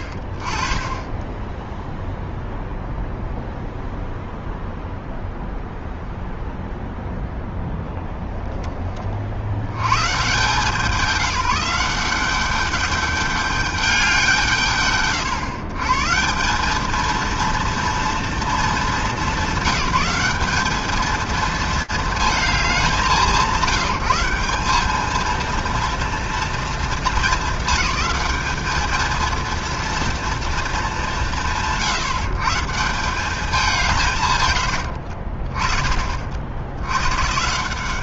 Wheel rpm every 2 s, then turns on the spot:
10, 0, 0, 0, 10, 140, 200, 110, 190, 210, 200, 200, 190, 230, 210, 230, 140, 160, 70.
none